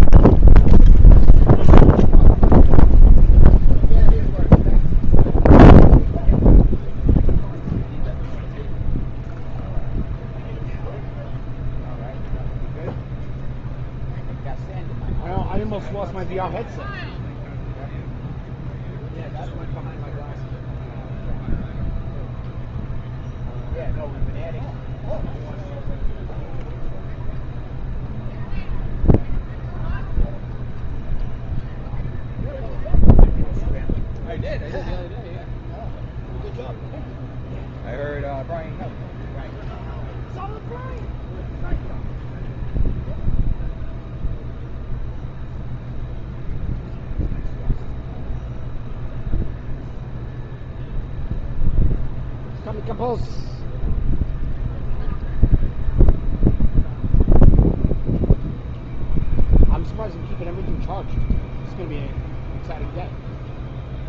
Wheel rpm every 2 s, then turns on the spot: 0, 0, 0, 0, 0, 0, 0, 0, 0, 0, 0, 0, 0, 0, 0, 0, 0, 0, 0, 0, 0, 0, 0, 0, 0, 0, 0, 0, 0, 0, 0, 0.
none